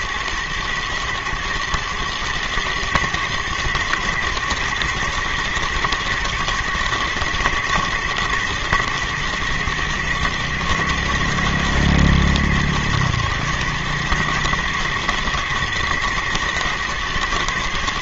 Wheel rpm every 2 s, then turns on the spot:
110, 110, 120, 120, 120, 120, 110, 110, 110.
none